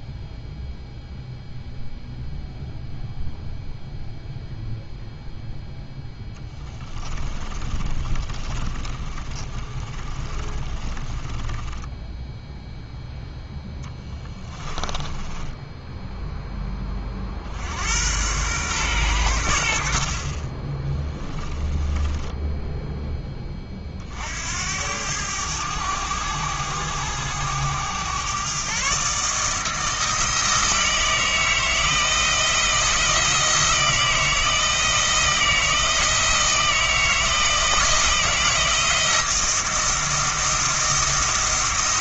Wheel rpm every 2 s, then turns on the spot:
0, 0, 0, 20, 30, 20, 0, 20, 20, 110, 20, 10, 80, 100, 140, 160, 160, 160, 160, 170, 170.
6-12 14-16 20-22